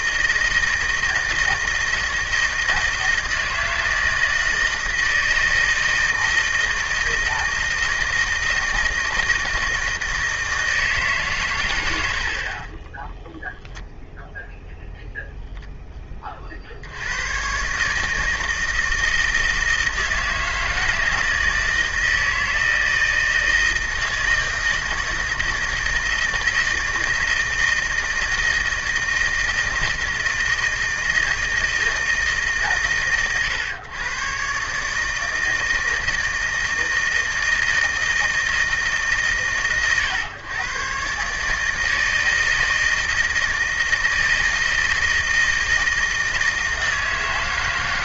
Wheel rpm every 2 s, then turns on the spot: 160, 160, 160, 160, 160, 160, 60, 0, 20, 150, 160, 160, 160, 160, 160, 160, 150, 120, 160, 160, 120, 160, 160, 160.
none